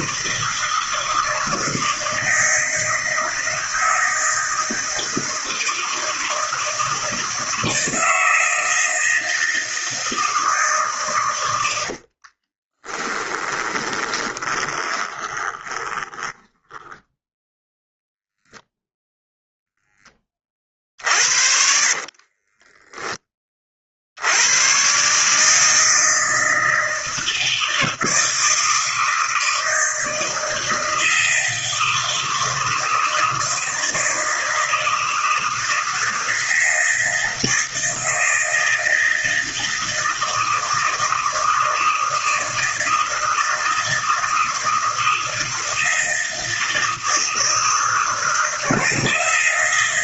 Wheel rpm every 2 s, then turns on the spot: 160, 160, 160, 160, 160, 150, 30, 20, 10, 0, 30, 30, 100, 160, 160, 160, 160, 160, 160, 160, 160, 160, 160, 160, 160.
12-18 22-24